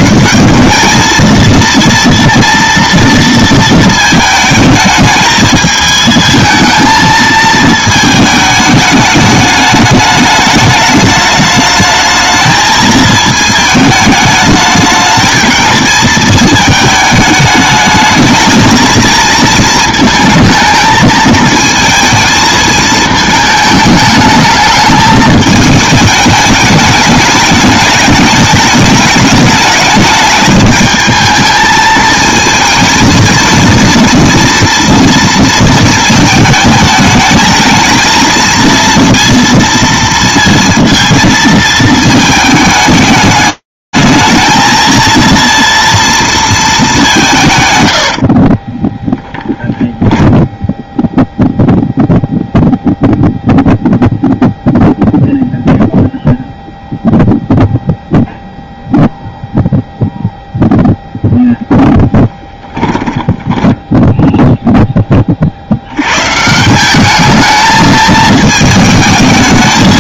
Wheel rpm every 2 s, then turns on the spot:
200, 230, 220, 220, 210, 210, 220, 210, 220, 220, 220, 220, 210, 210, 210, 220, 220, 230, 220, 230, 230, 210, 230, 180, 20, 0, 0, 0, 0, 0, 0, 10, 10, 190, 220.
48-50 62-64